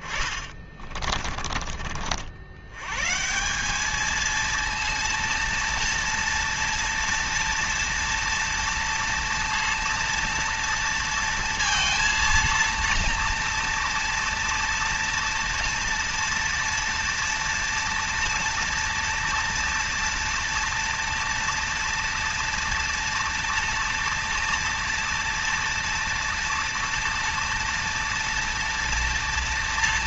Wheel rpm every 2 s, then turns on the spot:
30, 140, 230, 230, 230, 230, 230, 230, 230, 230, 230, 230, 230, 230, 230.
0-2